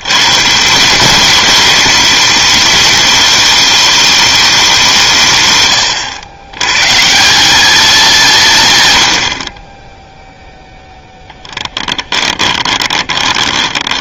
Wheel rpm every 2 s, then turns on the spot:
160, 210, 190, 120, 110, 10, 20.
12-14